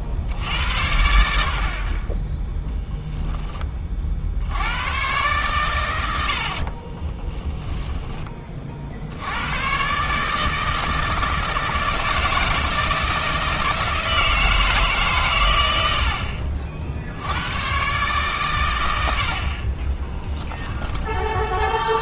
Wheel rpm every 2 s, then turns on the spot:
70, 0, 100, 30, 50, 160, 160, 150, 60, 110, 10.
6-8 20-22